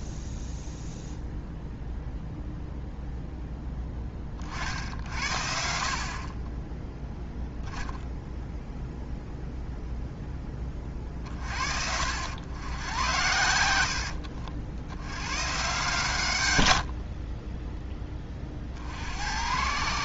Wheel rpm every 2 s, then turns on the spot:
0, 0, 50, 20, 0, 20, 100, 70, 100, 40.
none